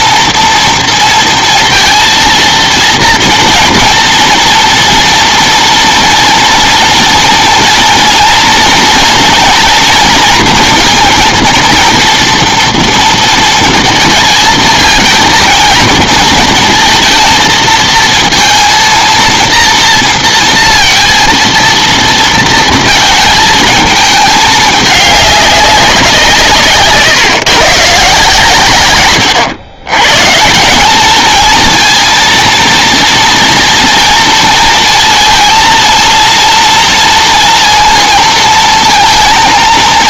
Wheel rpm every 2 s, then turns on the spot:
230, 230, 230, 230, 230, 230, 230, 220, 230, 230, 230, 230, 210, 150, 140, 160, 230, 230, 230, 230.
none